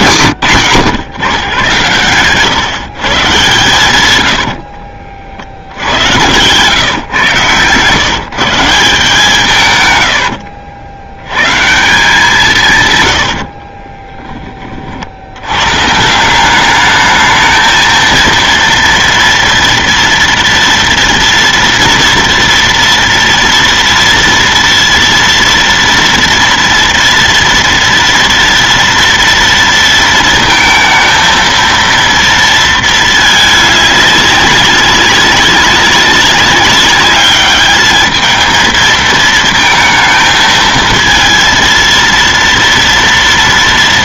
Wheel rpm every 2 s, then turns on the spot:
120, 130, 60, 120, 160, 70, 140, 40, 200, 230, 230, 230, 230, 230, 230, 230, 220, 200, 200, 220, 220, 230.
4-6